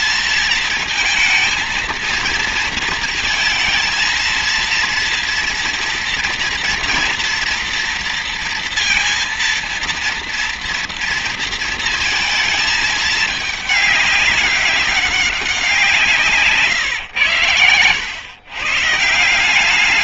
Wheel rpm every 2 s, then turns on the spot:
230, 230, 230, 240, 230, 230, 220, 200, 110, 150.
none